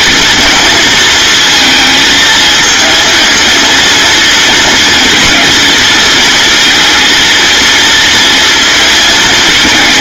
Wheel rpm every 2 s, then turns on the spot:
230, 230, 230, 230, 220.
none